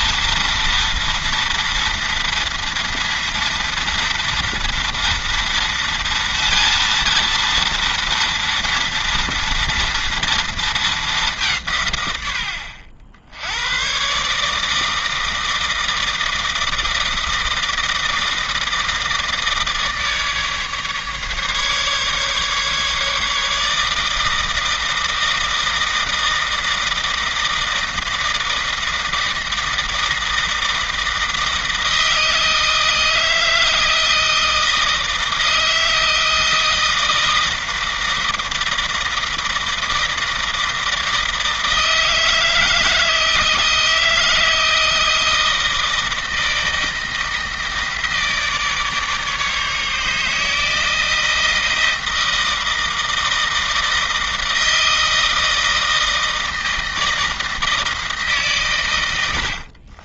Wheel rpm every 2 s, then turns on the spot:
230, 230, 230, 230, 230, 210, 70, 160, 160, 160, 150, 150, 160, 160, 160, 160, 160, 160, 160, 160, 160, 160, 160, 160, 150, 160, 160, 160, 160, 110.
none